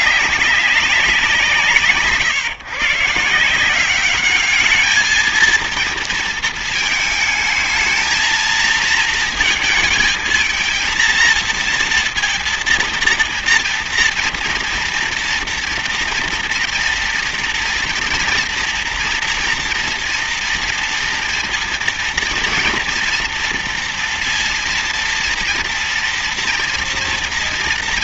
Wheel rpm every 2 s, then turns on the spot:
190, 150, 210, 220, 230, 230, 230, 230, 230, 240, 230, 230, 230, 230.
none